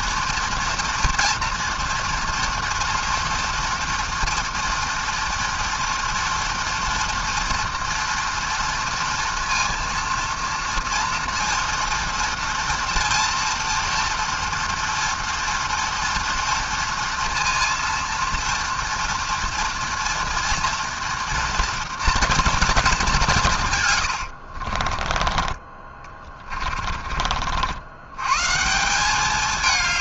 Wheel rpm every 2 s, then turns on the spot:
230, 230, 230, 230, 230, 230, 230, 230, 230, 230, 230, 230, 60, 40, 150.
24-28